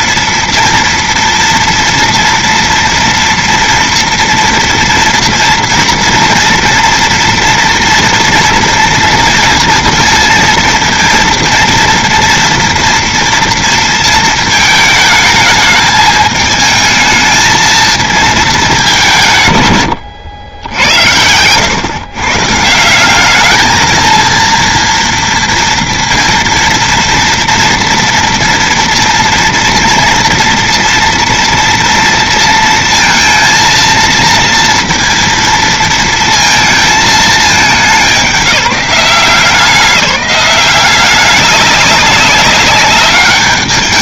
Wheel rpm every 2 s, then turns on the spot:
230, 230, 230, 230, 230, 230, 230, 230, 220, 220, 90, 140, 230, 230, 230, 230, 230, 230, 230, 180, 190, 200.
none